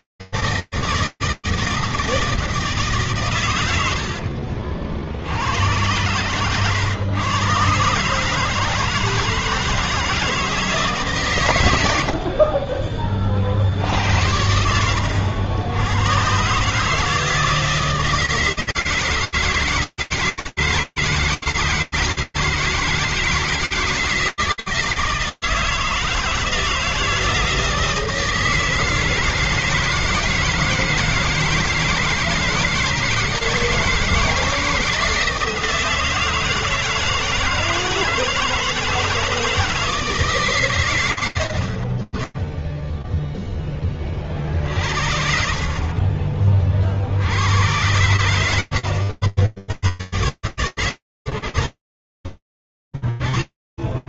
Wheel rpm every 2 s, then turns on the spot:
160, 160, 70, 110, 150, 160, 50, 90, 130, 160, 160, 160, 160, 160, 160, 160, 150, 160, 160, 160, 130, 10, 50, 70, 70, 120, 50.
4-6 12-14